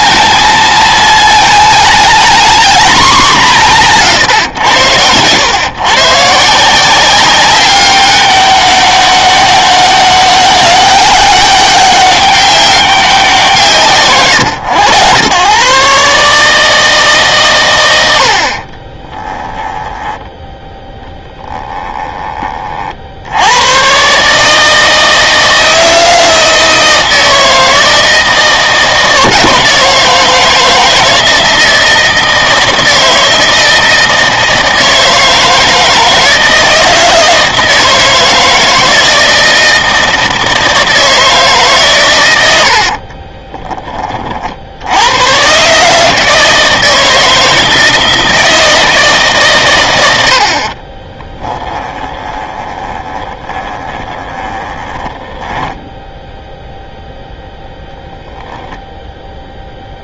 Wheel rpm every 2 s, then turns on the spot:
230, 220, 110, 170, 200, 200, 200, 110, 150, 40, 10, 40, 160, 160, 170, 160, 160, 160, 160, 160, 160, 70, 70, 160, 160, 50, 20, 20, 0, 0.
18-20 42-44 52-56